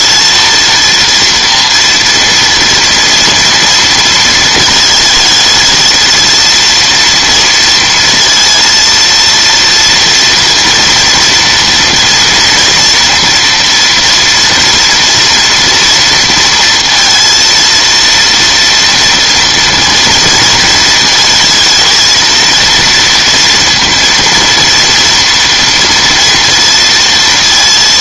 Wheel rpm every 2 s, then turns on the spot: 230, 230, 220, 230, 230, 230, 230, 230, 230, 230, 230, 230, 230, 230.
none